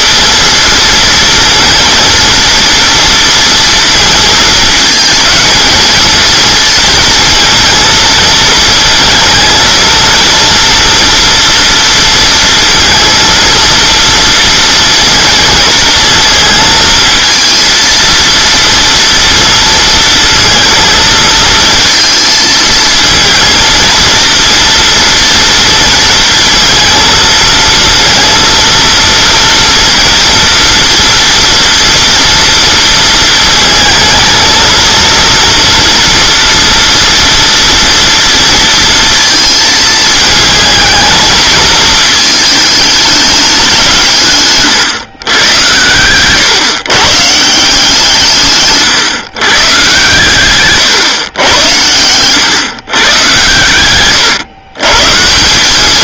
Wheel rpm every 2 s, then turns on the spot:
230, 230, 220, 230, 230, 230, 230, 240, 220, 230, 220, 230, 230, 230, 230, 230, 230, 230, 240, 230, 220, 210, 140, 140, 130, 130, 130, 120.
none